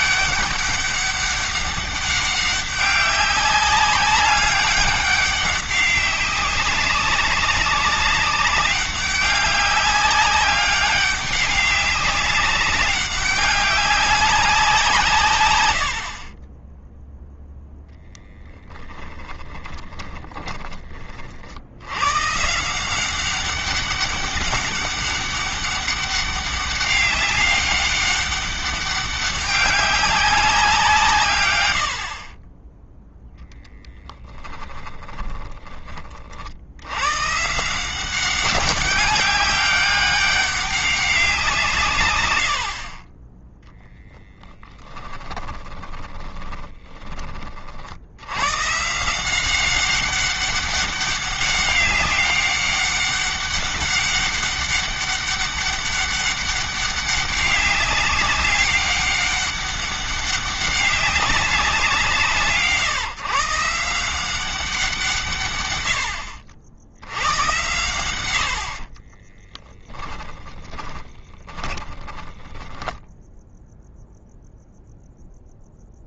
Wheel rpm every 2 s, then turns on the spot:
200, 200, 200, 190, 200, 200, 200, 150, 10, 10, 30, 160, 200, 200, 200, 170, 10, 20, 100, 190, 190, 50, 20, 20, 150, 200, 200, 200, 200, 200, 200, 160, 170, 80, 50, 20, 10, 0.
18-20 32-36 44-46 68-74